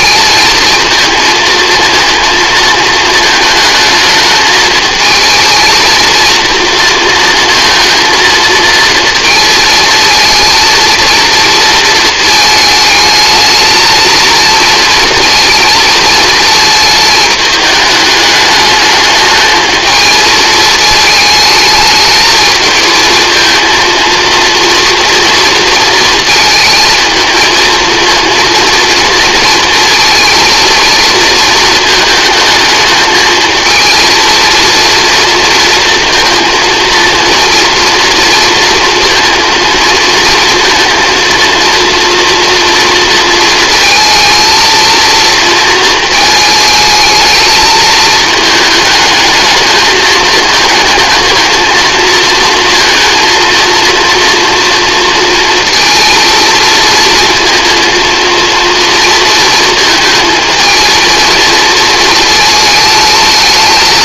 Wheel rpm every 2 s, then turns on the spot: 230, 220, 230, 230, 230, 230, 220, 220, 210, 220, 210, 230, 230, 230, 230, 220, 220, 230, 230, 220, 230, 220, 220, 220, 220, 230, 230, 230, 230, 230, 230, 220.
none